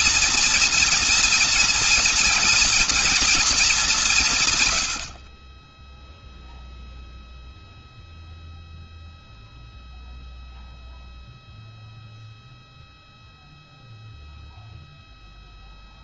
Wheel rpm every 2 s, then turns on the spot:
230, 230, 150, 0, 0, 0, 0, 0.
none